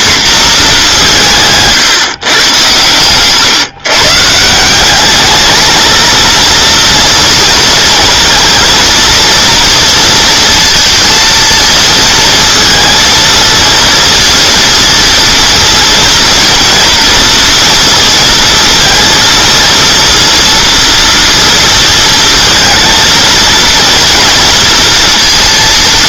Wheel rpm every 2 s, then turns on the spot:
230, 120, 180, 230, 230, 230, 230, 230, 230, 230, 240, 230, 230.
none